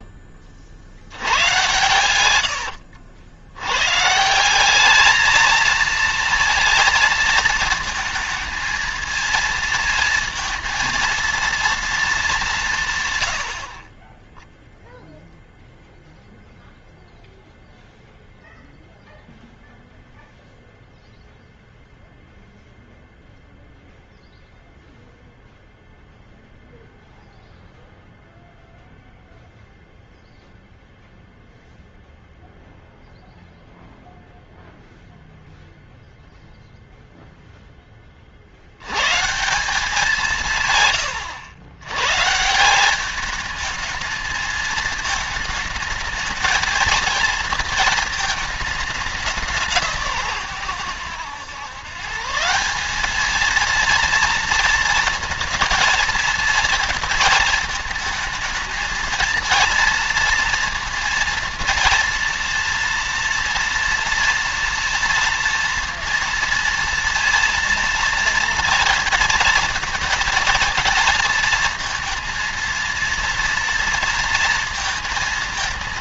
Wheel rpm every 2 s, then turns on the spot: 60, 90, 190, 230, 220, 230, 170, 0, 0, 0, 0, 0, 0, 0, 0, 0, 0, 0, 0, 50, 160, 160, 220, 220, 220, 140, 170, 230, 230, 220, 230, 230, 230, 230, 230, 230, 230, 230.
2-4